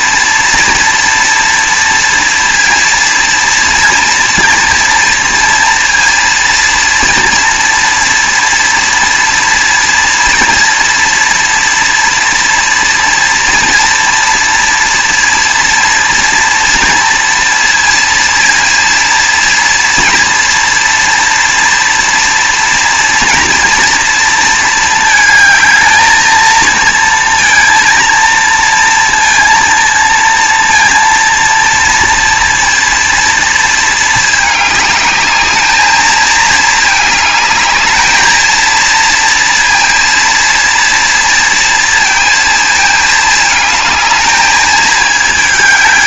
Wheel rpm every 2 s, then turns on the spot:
230, 230, 230, 230, 230, 230, 230, 230, 230, 230, 230, 230, 220, 220, 230, 230, 230, 210, 220, 230, 240, 220, 220.
none